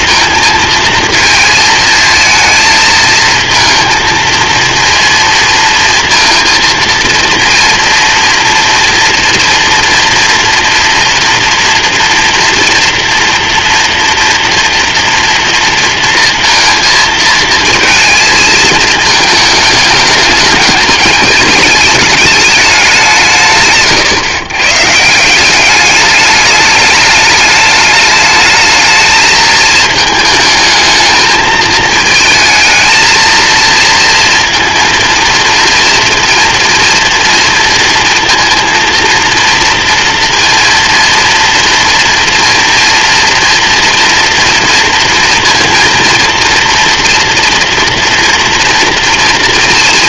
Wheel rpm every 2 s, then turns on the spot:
230, 220, 230, 230, 230, 230, 240, 230, 230, 220, 210, 210, 130, 210, 220, 220, 220, 230, 230, 230, 230, 230, 230, 230, 230.
none